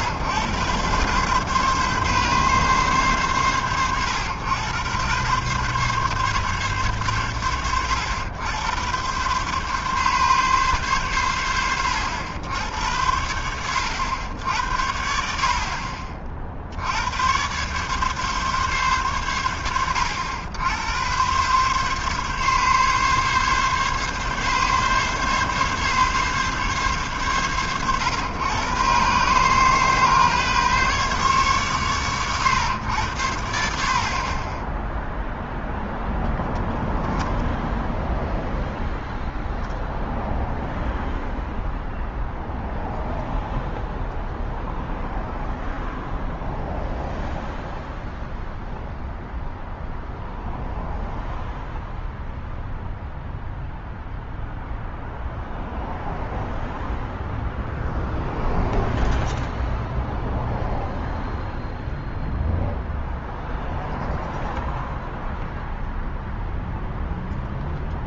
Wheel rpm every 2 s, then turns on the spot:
130, 100, 130, 100, 120, 80, 90, 50, 100, 80, 120, 140, 140, 100, 130, 130, 80, 0, 0, 0, 0, 0, 0, 0, 0, 0, 0, 0, 0, 0, 0, 0, 0, 0.
none